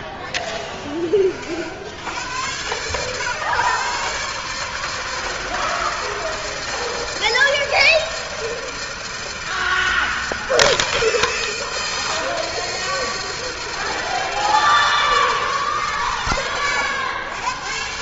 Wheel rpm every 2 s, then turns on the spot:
70, 140, 160, 160, 160, 160, 160, 130, 120.
none